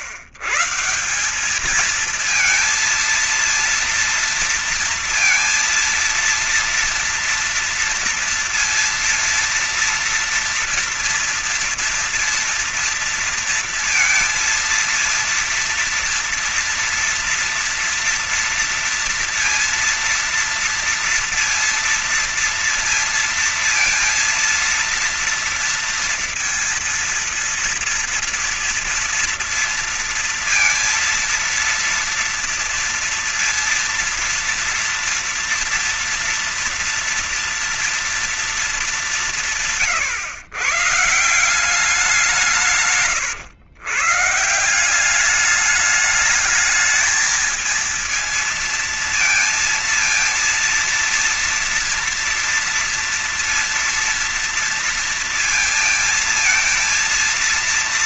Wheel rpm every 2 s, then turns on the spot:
130, 220, 230, 230, 230, 230, 240, 230, 230, 230, 230, 230, 230, 230, 230, 230, 230, 230, 230, 230, 140, 170, 140, 210, 230, 230, 230, 230, 230.
none